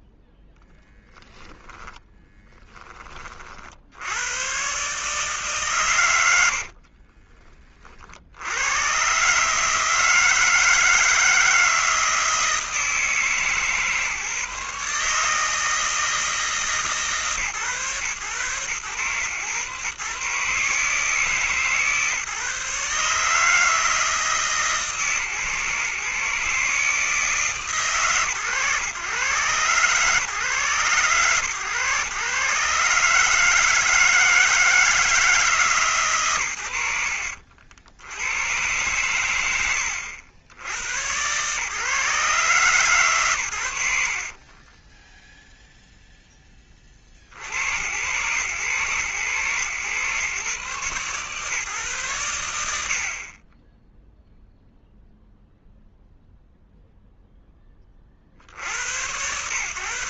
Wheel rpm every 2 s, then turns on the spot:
10, 10, 120, 90, 110, 160, 160, 150, 150, 110, 140, 150, 150, 140, 120, 130, 130, 160, 120, 100, 90, 140, 40, 10, 110, 130, 90, 0, 0, 70.
44-46